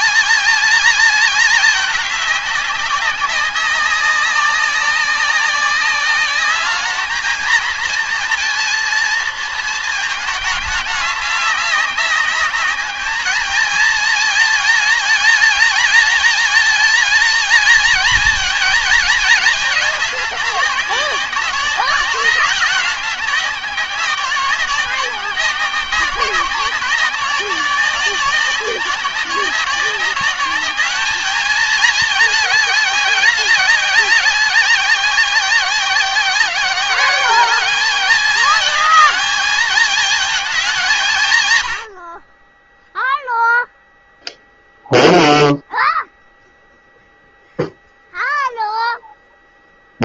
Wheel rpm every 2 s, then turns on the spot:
220, 200, 190, 200, 230, 210, 210, 220, 220, 230, 200, 190, 190, 180, 190, 200, 210, 190, 180, 220, 200, 20, 0, 0, 0.
none